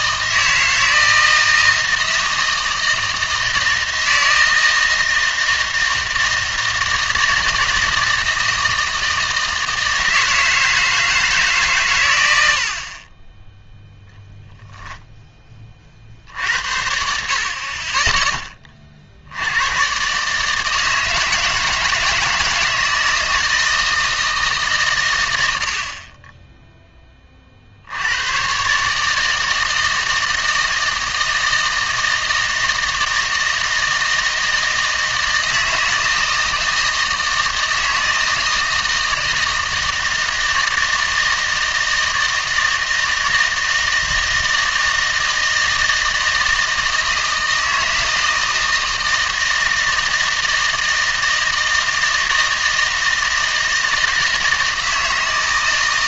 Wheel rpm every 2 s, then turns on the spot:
160, 160, 160, 160, 160, 160, 70, 0, 60, 20, 150, 160, 150, 10, 130, 160, 160, 160, 160, 160, 160, 160, 160, 160, 160, 160, 160, 160.
none